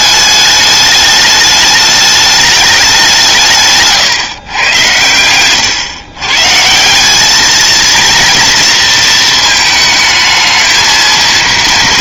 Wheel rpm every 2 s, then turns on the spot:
210, 210, 130, 130, 230, 220.
none